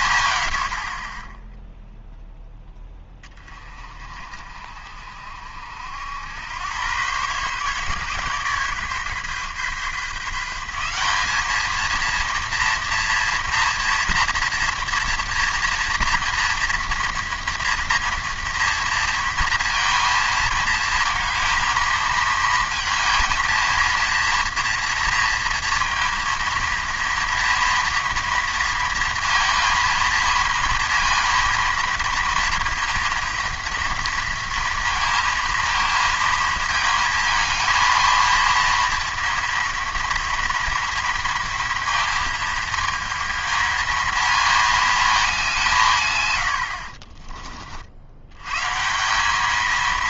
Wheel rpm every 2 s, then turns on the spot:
60, 10, 50, 100, 140, 180, 230, 230, 230, 230, 230, 230, 230, 230, 230, 230, 230, 230, 220, 230, 230, 220, 220, 80, 140.
none